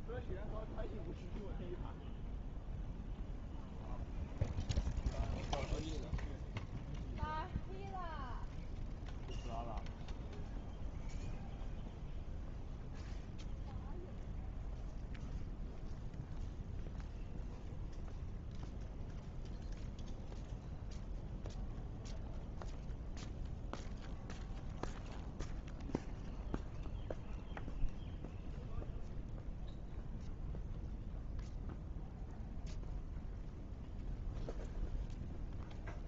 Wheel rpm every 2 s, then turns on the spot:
0, 0, 0, 0, 0, 0, 0, 0, 0, 0, 0, 0, 0, 0, 0, 0, 0, 0.
none